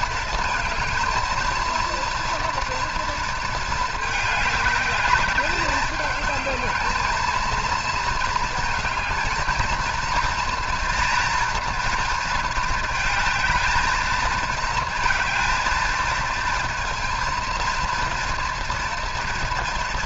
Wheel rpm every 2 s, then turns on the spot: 220, 230, 210, 220, 220, 230, 220, 220, 230, 230.
none